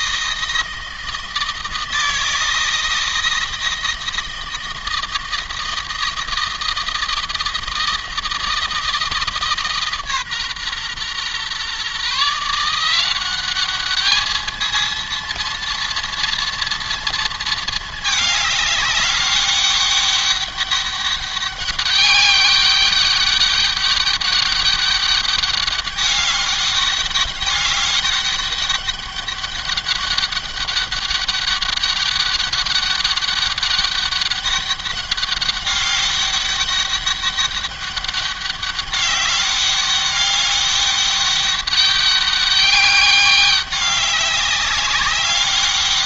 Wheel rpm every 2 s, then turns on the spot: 160, 170, 160, 160, 160, 130, 180, 230, 230, 200, 200, 200, 200, 200, 200, 200, 200, 200, 200, 200, 200, 200, 190.
none